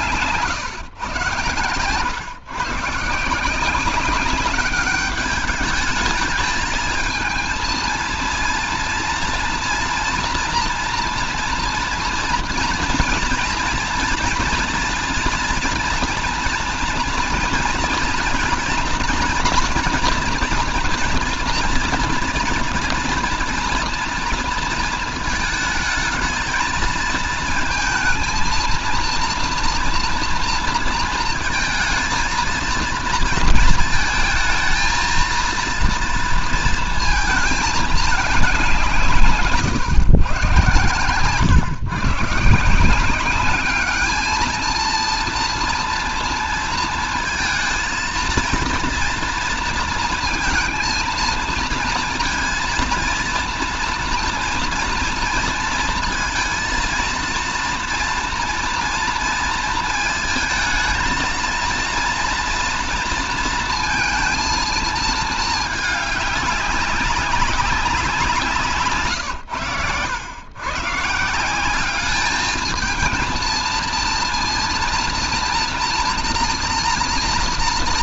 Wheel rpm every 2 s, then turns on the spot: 130, 140, 200, 220, 230, 240, 240, 230, 230, 240, 230, 230, 230, 220, 230, 230, 230, 220, 230, 170, 130, 170, 230, 230, 230, 230, 230, 230, 230, 230, 220, 230, 230, 200, 160, 140, 220, 230, 240.
40-42